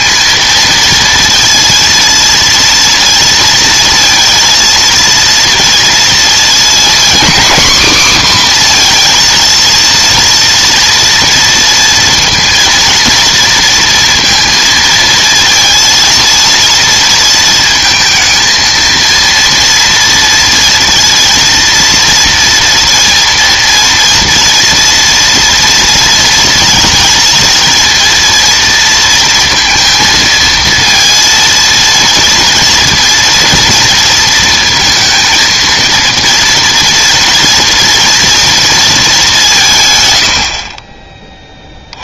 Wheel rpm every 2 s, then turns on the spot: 230, 230, 230, 250, 240, 230, 230, 220, 230, 230, 230, 230, 230, 230, 230, 230, 230, 230, 230, 220, 30.
none